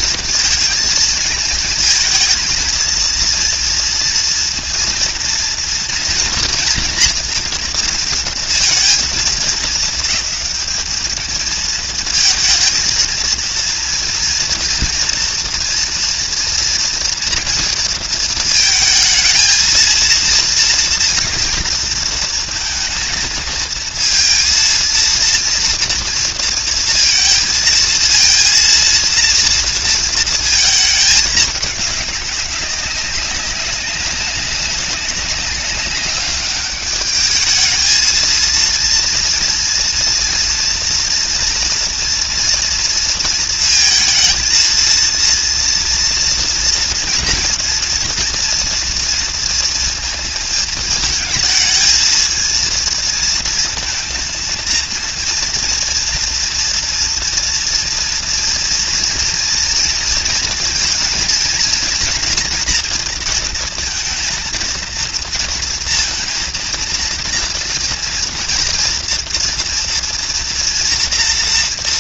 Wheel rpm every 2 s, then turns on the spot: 230, 230, 230, 230, 230, 210, 230, 230, 230, 220, 230, 230, 230, 230, 230, 220, 200, 200, 200, 230, 230, 230, 230, 230, 230, 220, 230, 230, 230, 240, 230, 230, 230, 230, 230, 230.
none